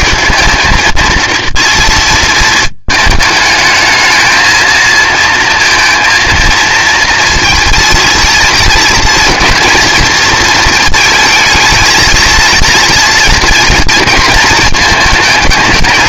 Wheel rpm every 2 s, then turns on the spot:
220, 220, 230, 230, 230, 230, 230, 220.
none